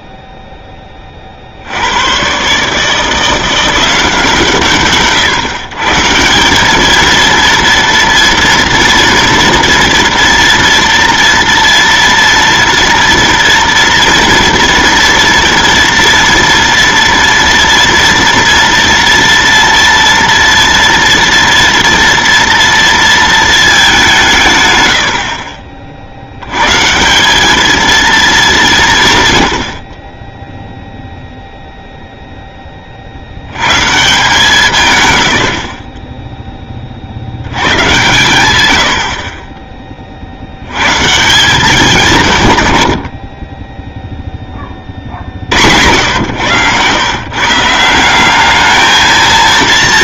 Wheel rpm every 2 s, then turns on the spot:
0, 80, 170, 140, 230, 230, 240, 230, 230, 230, 230, 230, 200, 70, 220, 40, 0, 160, 20, 120, 70, 130, 30, 110, 210.
none